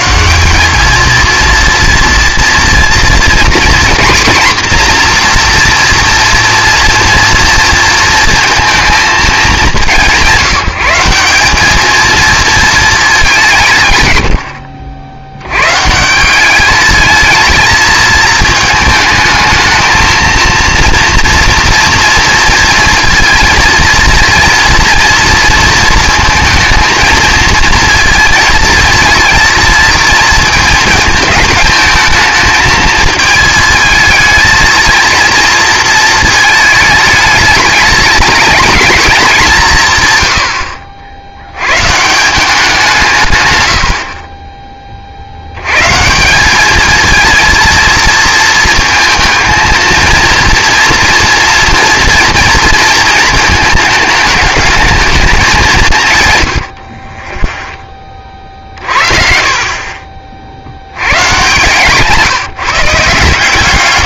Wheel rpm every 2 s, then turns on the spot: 200, 230, 240, 230, 230, 180, 220, 70, 200, 220, 230, 230, 230, 230, 230, 220, 220, 230, 220, 220, 70, 180, 30, 210, 220, 230, 230, 210, 140, 40, 80, 170.
14-16 56-58